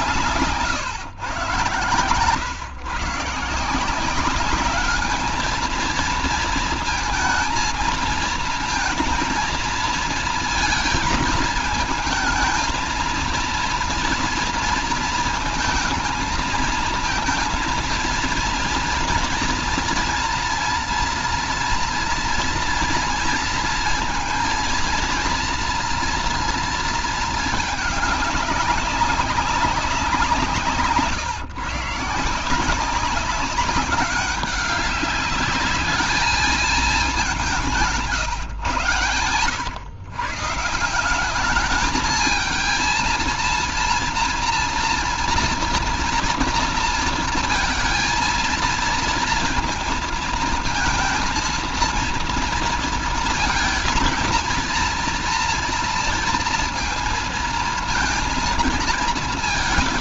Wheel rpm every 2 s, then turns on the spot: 160, 130, 200, 230, 220, 230, 220, 230, 220, 230, 230, 230, 230, 230, 200, 170, 170, 190, 210, 140, 150, 220, 230, 230, 230, 230, 230, 230, 230, 230.
none